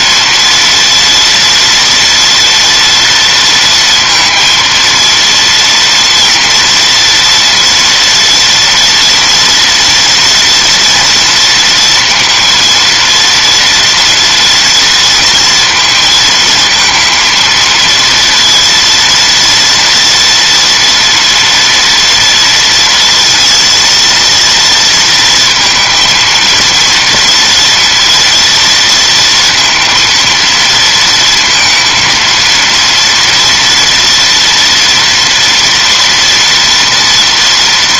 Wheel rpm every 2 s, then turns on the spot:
230, 230, 230, 240, 230, 240, 230, 230, 220, 230, 240, 230, 230, 230, 230, 230, 230, 230, 230.
none